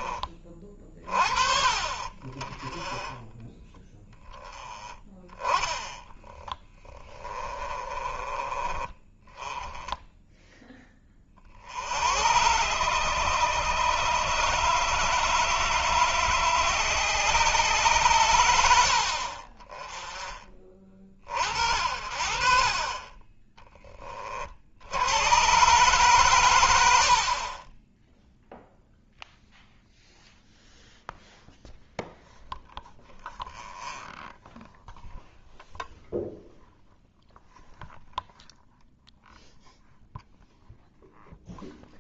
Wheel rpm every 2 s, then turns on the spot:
30, 30, 20, 20, 20, 10, 120, 130, 130, 80, 20, 50, 50, 100, 0, 0, 0, 0, 0, 0, 0.
6-8